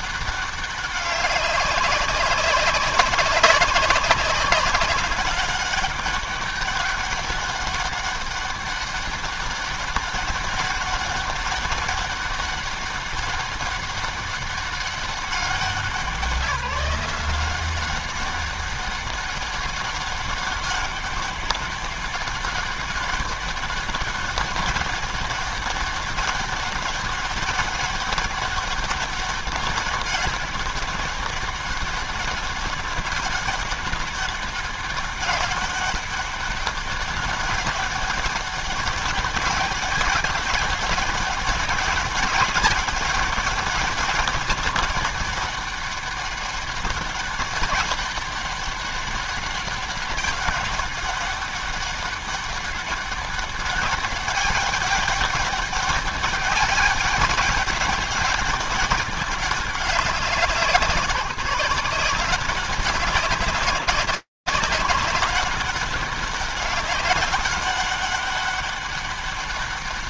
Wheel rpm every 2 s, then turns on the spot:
190, 190, 200, 200, 200, 200, 200, 200, 180, 190, 200, 200, 200, 200, 200, 200, 200, 200, 200, 200, 200, 200, 200, 200, 200, 200, 200, 200, 200, 200, 170, 180, 200, 190, 200.
none